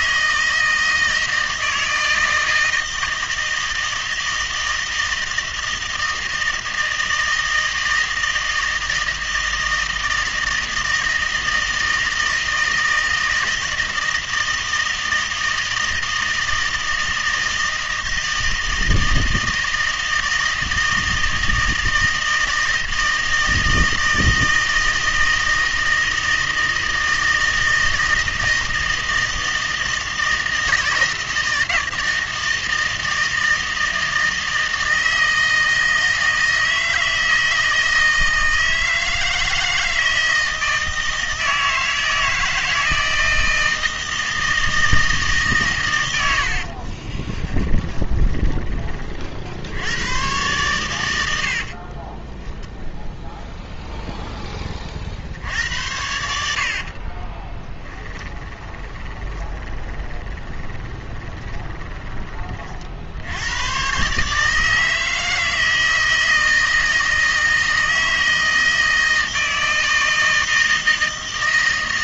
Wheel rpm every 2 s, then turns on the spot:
160, 160, 160, 160, 160, 160, 160, 160, 160, 160, 160, 160, 160, 160, 160, 160, 160, 160, 160, 160, 160, 160, 160, 60, 20, 110, 0, 20, 70, 20, 20, 40, 150, 160, 160, 160.
46-48 58-62